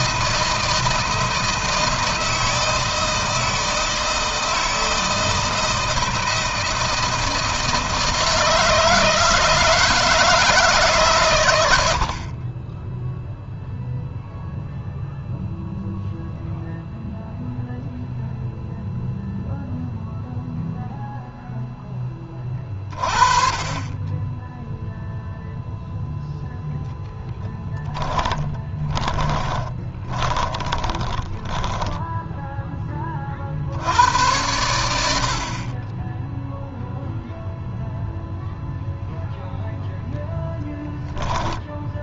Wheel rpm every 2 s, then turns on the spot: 160, 160, 160, 160, 160, 140, 10, 0, 0, 0, 0, 30, 0, 0, 20, 20, 20, 90, 0, 0, 10.
28-32 40-42